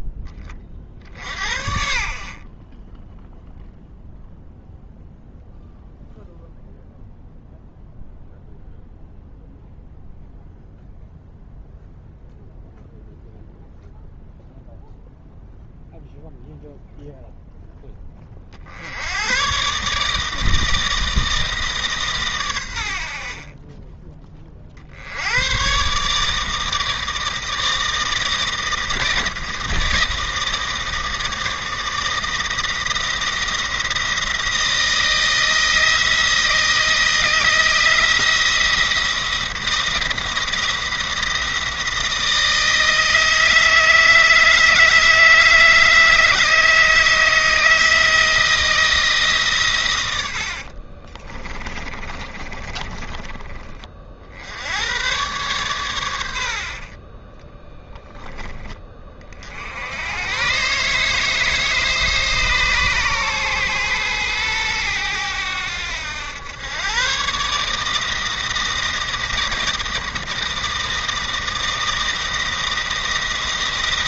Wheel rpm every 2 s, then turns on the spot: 30, 30, 0, 0, 0, 0, 0, 0, 0, 60, 160, 100, 50, 160, 160, 160, 160, 170, 160, 170, 170, 160, 160, 160, 160, 60, 20, 80, 70, 20, 130, 140, 110, 110, 170, 160, 170.
50-54 56-58